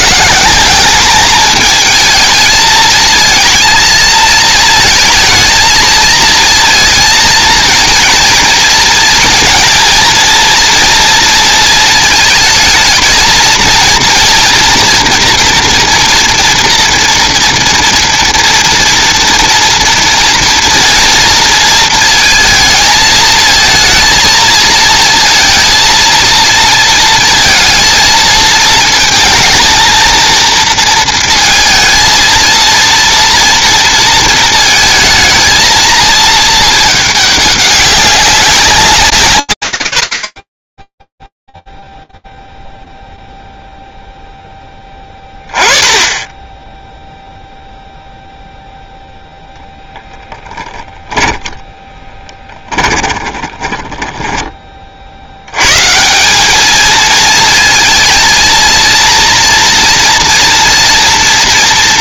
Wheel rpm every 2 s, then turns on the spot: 210, 220, 220, 230, 230, 230, 220, 230, 230, 230, 230, 220, 230, 230, 220, 230, 230, 220, 220, 180, 10, 0, 10, 10, 0, 10, 20, 60, 220, 230, 230.
50-54